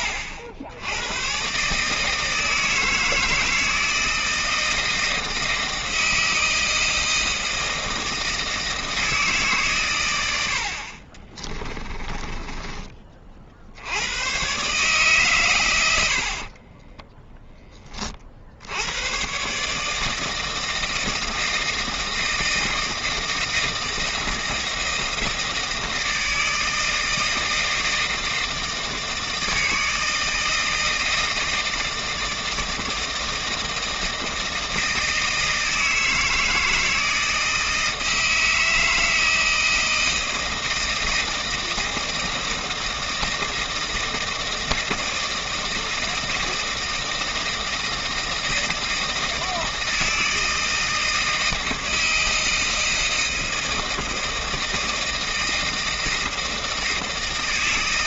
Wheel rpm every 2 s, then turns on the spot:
80, 160, 160, 160, 160, 50, 20, 140, 30, 80, 160, 160, 160, 160, 160, 160, 160, 160, 160, 160, 160, 160, 160, 160, 160, 160, 160, 160, 160.
12-14 16-18